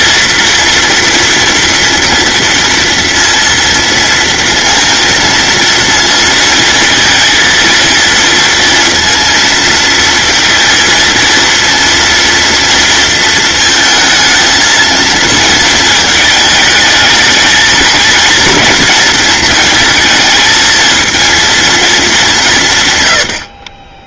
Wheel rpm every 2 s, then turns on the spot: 230, 230, 230, 230, 230, 230, 230, 220, 220, 230, 220, 160.
none